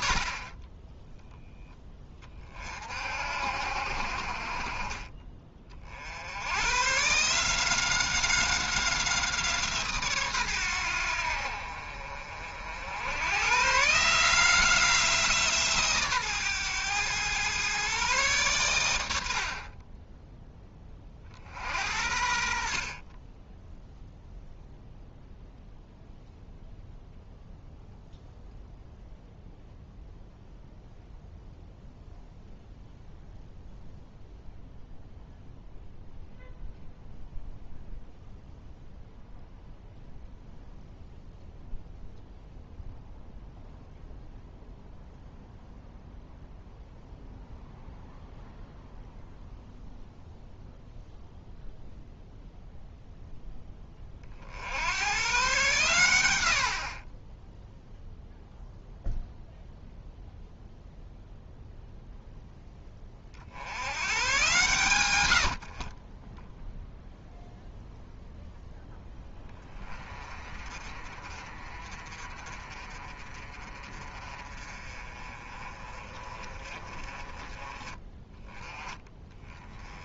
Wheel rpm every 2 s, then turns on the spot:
30, 50, 40, 130, 180, 100, 70, 170, 120, 110, 20, 50, 0, 0, 0, 0, 0, 0, 0, 0, 0, 0, 0, 0, 0, 0, 0, 70, 60, 0, 0, 10, 110, 0, 0, 30, 40, 30, 20, 10.
none